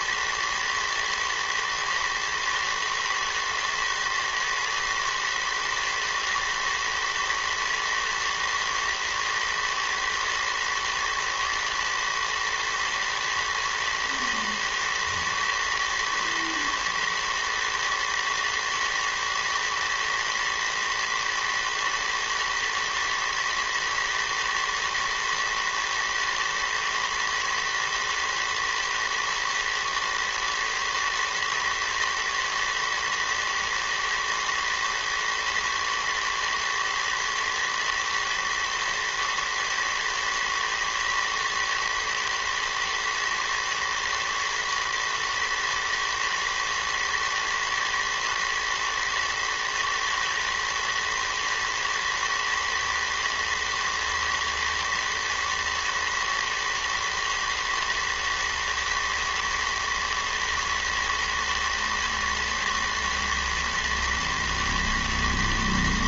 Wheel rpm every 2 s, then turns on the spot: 110, 110, 110, 110, 120, 110, 110, 110, 110, 110, 110, 110, 110, 110, 110, 110, 110, 110, 110, 110, 110, 120, 120, 110, 110, 110, 120, 120, 110, 110, 110, 110, 110.
none